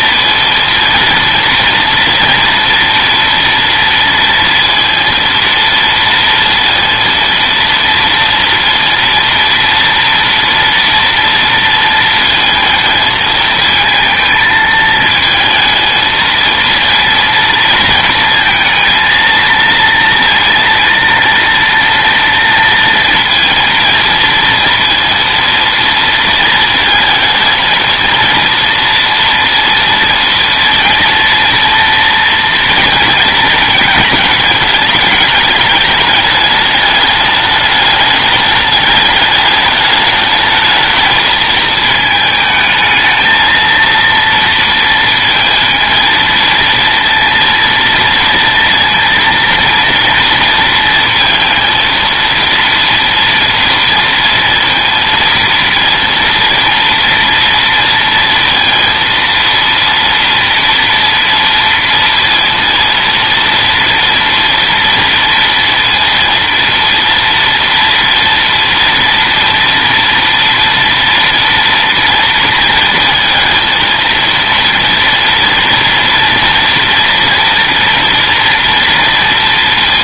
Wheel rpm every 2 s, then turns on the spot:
230, 230, 230, 230, 230, 240, 220, 220, 230, 230, 230, 230, 230, 220, 230, 230, 230, 220, 210, 210, 220, 220, 230, 230, 230, 230, 230, 230, 230, 230, 230, 230, 230, 230, 240, 230, 230, 230, 240, 230.
none